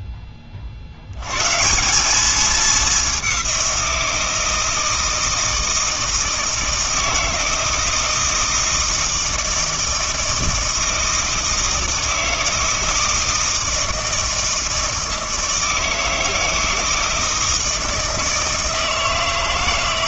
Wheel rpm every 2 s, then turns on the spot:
50, 200, 160, 160, 160, 160, 160, 160, 160, 160.
none